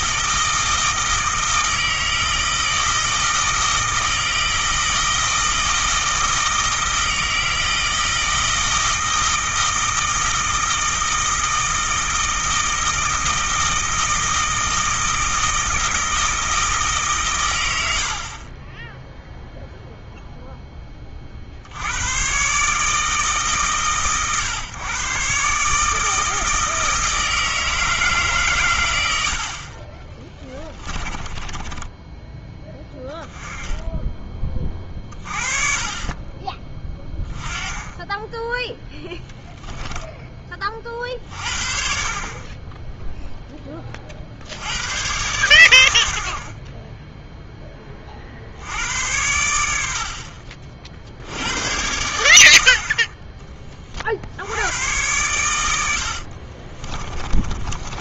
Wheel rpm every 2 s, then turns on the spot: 160, 160, 160, 160, 160, 160, 160, 160, 150, 10, 20, 140, 120, 160, 100, 20, 10, 30, 20, 10, 40, 10, 100, 10, 80, 50, 60, 100, 30.
30-32 56-58